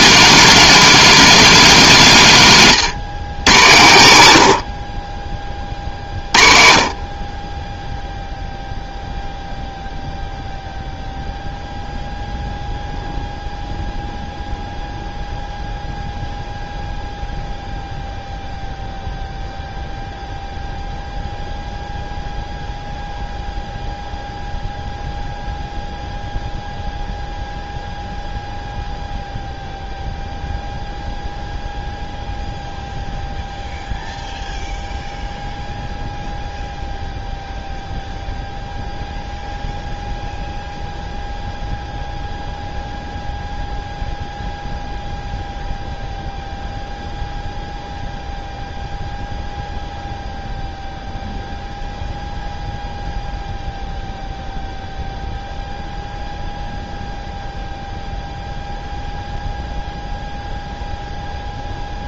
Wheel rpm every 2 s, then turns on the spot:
230, 140, 50, 40, 0, 0, 0, 0, 0, 0, 0, 0, 0, 0, 0, 0, 0, 0, 0, 0, 0, 0, 0, 0, 0, 0, 0, 0, 0, 0, 0.
none